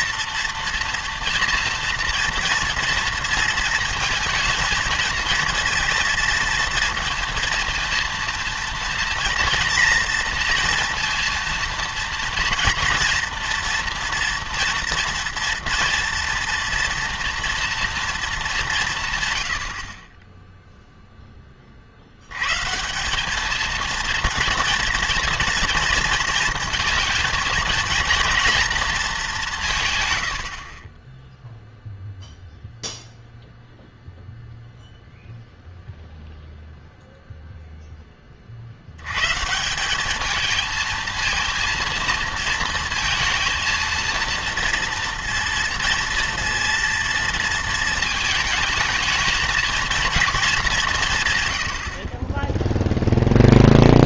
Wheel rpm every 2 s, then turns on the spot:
240, 230, 230, 230, 230, 230, 230, 230, 230, 170, 0, 150, 230, 230, 230, 50, 0, 0, 0, 70, 220, 230, 230, 230, 220, 190, 10.
none